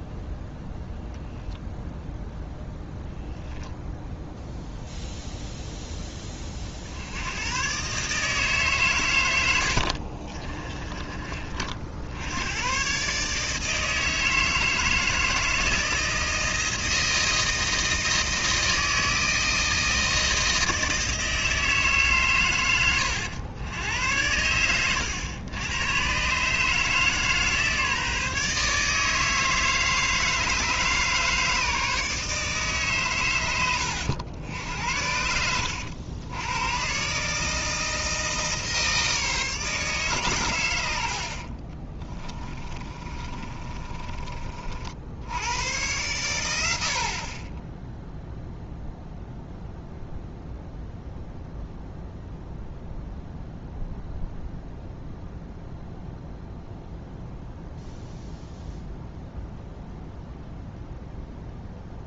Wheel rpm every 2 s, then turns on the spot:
0, 0, 0, 50, 140, 20, 120, 160, 160, 160, 160, 100, 110, 150, 150, 150, 140, 80, 120, 160, 90, 30, 60, 70, 0, 0, 0, 0, 0, 0, 0.
10-12 42-44